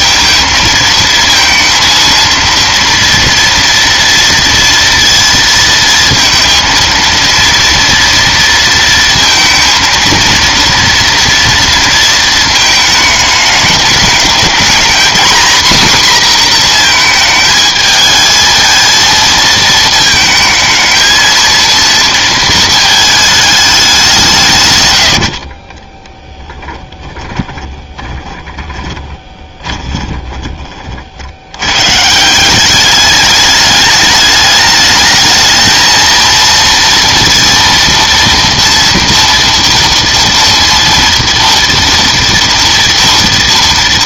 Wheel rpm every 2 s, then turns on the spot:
230, 230, 230, 230, 230, 230, 210, 240, 230, 230, 220, 220, 90, 10, 20, 50, 200, 210, 230, 230, 230, 230.
24-30